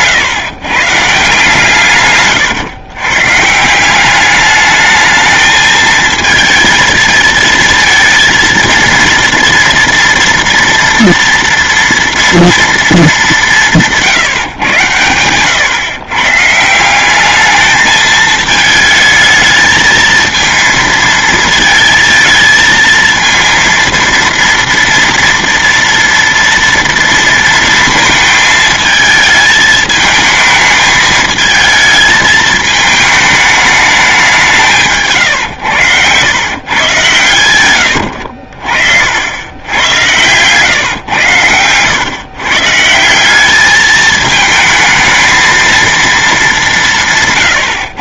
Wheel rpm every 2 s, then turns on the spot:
140, 120, 210, 220, 230, 230, 230, 120, 150, 220, 220, 220, 230, 230, 220, 220, 220, 170, 120, 60, 130, 150, 220, 190.
none